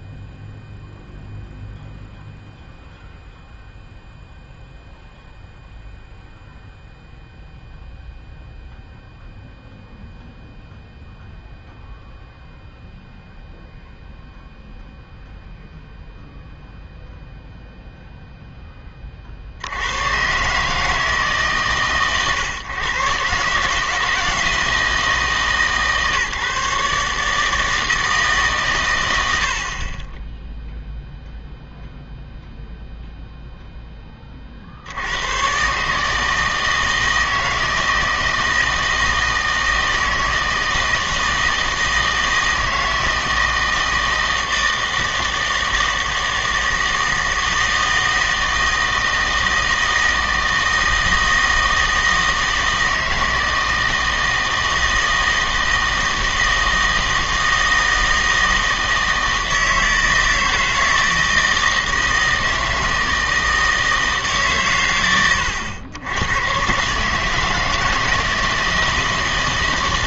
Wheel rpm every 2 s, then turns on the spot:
0, 0, 0, 0, 0, 0, 0, 0, 0, 10, 150, 140, 160, 150, 120, 0, 0, 50, 160, 160, 160, 160, 160, 160, 160, 160, 160, 160, 160, 160, 160, 160, 130, 130, 160.
none